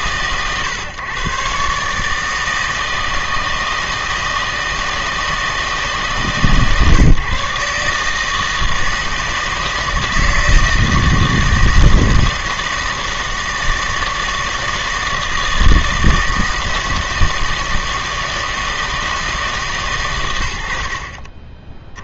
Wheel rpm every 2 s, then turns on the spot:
130, 160, 160, 150, 160, 160, 160, 160, 160, 160, 60.
none